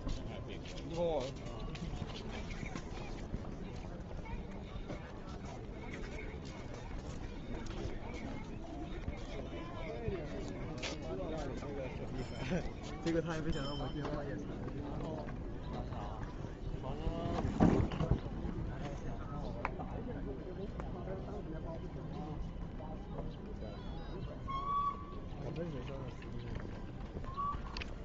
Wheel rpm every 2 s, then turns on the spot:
0, 0, 0, 0, 0, 0, 0, 0, 0, 0, 0, 0, 0, 0.
none